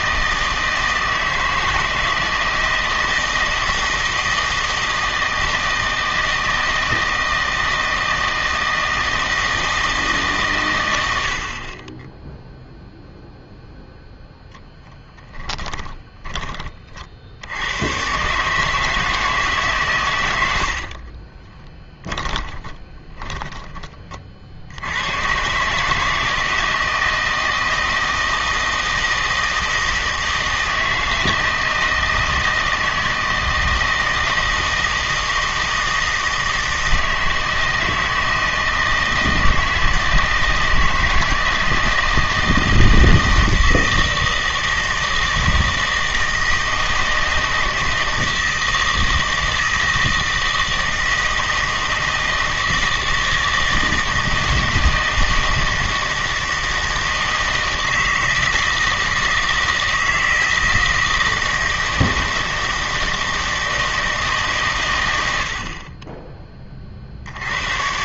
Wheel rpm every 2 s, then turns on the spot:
160, 160, 160, 160, 160, 100, 0, 0, 40, 150, 60, 20, 80, 160, 160, 160, 160, 160, 160, 160, 160, 160, 160, 160, 160, 160, 160, 160, 160, 160, 160, 160, 120, 30.
10-12 20-24